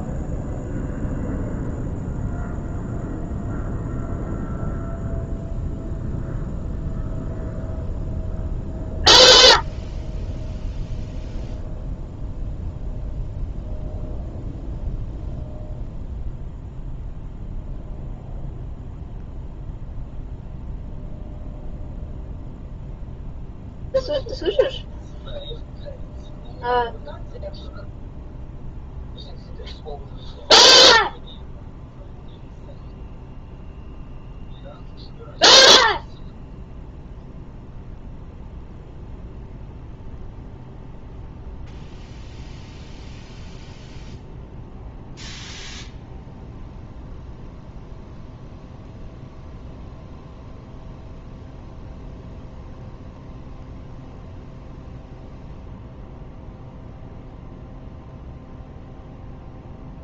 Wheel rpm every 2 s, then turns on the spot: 0, 0, 0, 0, 0, 0, 0, 0, 0, 0, 0, 0, 0, 0, 0, 0, 0, 0, 0, 0, 0, 0, 0, 0, 0, 0, 0, 0, 0, 0.
none